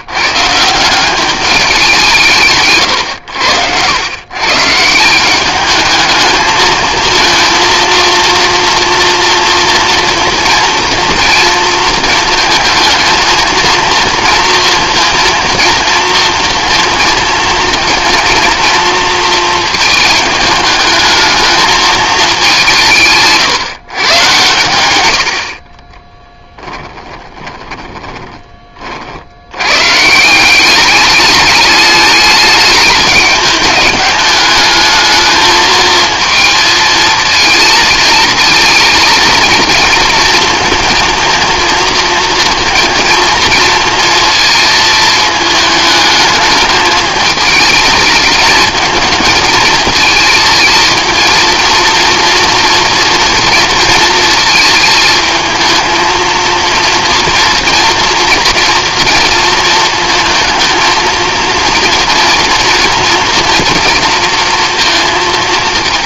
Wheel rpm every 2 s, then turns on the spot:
170, 130, 150, 220, 230, 230, 220, 230, 230, 230, 210, 170, 110, 10, 20, 190, 210, 210, 220, 220, 230, 230, 220, 210, 220, 220, 230, 220, 230, 230, 230, 230, 230.
26-28